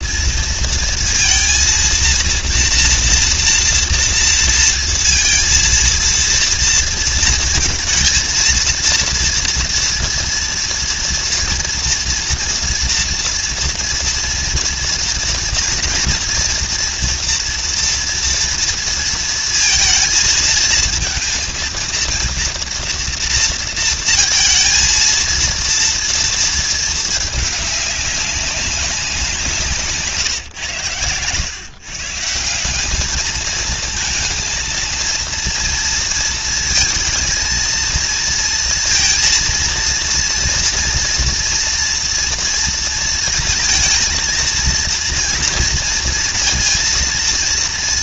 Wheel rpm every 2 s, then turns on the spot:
230, 240, 230, 230, 230, 240, 230, 230, 230, 230, 230, 230, 230, 210, 180, 110, 220, 230, 230, 230, 230, 230, 230, 230.
none